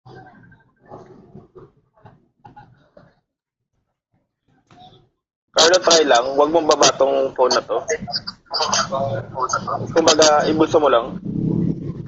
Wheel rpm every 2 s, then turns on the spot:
0, 0, 0, 0, 0, 0.
none